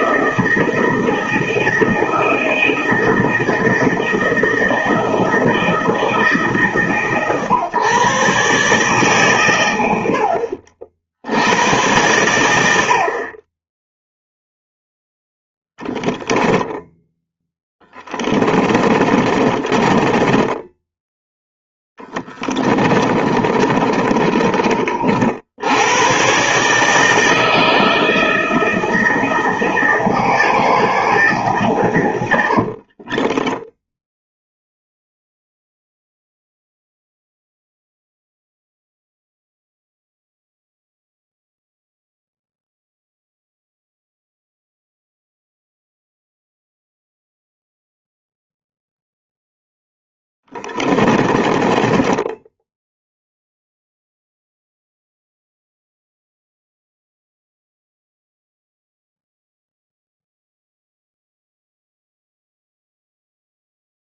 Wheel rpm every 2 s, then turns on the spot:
160, 160, 160, 140, 140, 60, 70, 0, 0, 20, 10, 20, 40, 140, 160, 160, 60, 0, 0, 0, 0, 0, 0, 0, 0, 20, 0, 0, 0, 0, 0, 0.
18-20 22-24 32-34 50-52